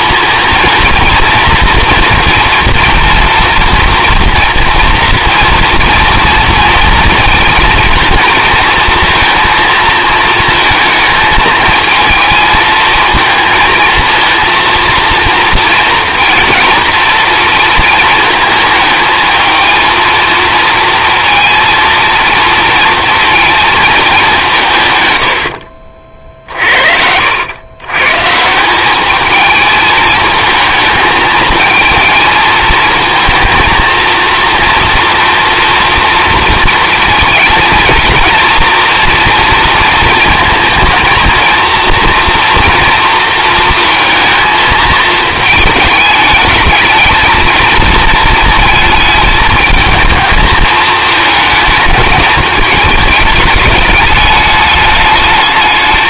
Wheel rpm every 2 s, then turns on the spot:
230, 230, 230, 230, 230, 220, 220, 230, 230, 220, 230, 230, 140, 60, 200, 220, 220, 230, 230, 240, 230, 230, 220, 220, 220, 220, 210, 210.
none